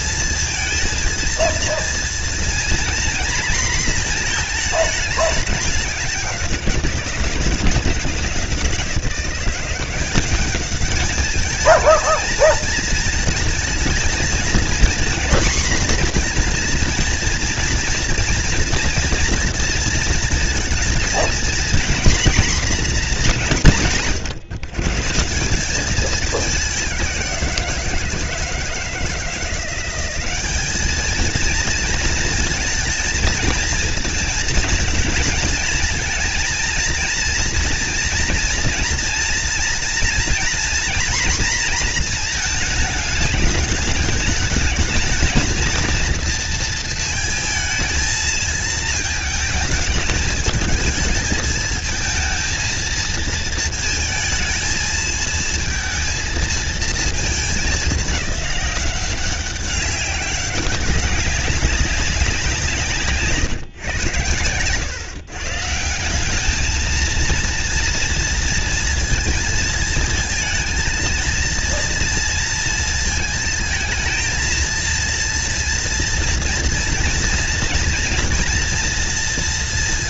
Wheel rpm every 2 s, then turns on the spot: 230, 230, 230, 190, 170, 200, 220, 230, 240, 240, 230, 240, 140, 200, 160, 200, 230, 220, 230, 240, 240, 230, 210, 230, 220, 220, 220, 220, 230, 200, 190, 180, 110, 200, 230, 230, 230, 220, 230, 230.
none